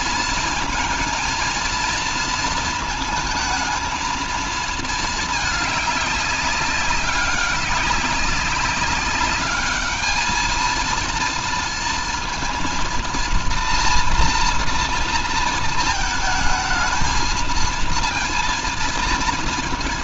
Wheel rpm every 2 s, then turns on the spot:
230, 230, 220, 200, 200, 220, 230, 230, 220, 230.
none